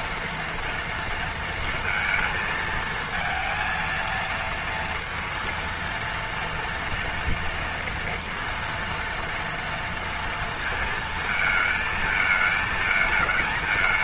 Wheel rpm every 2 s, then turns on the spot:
230, 220, 230, 230, 230, 230, 220.
none